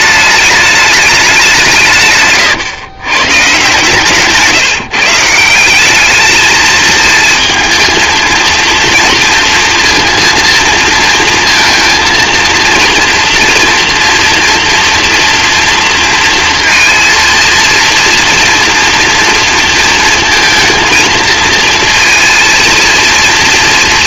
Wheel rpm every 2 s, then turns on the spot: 210, 130, 160, 220, 230, 230, 230, 230, 230, 230, 230, 230.
none